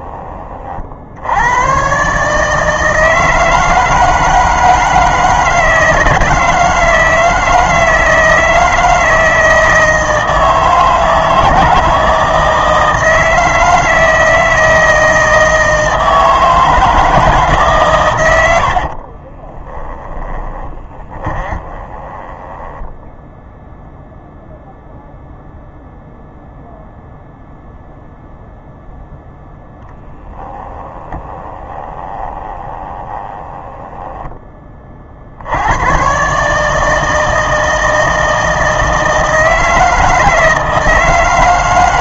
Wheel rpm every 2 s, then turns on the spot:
50, 160, 160, 160, 160, 160, 160, 160, 160, 50, 30, 10, 0, 0, 0, 10, 20, 30, 160, 160, 160.
18-24 30-34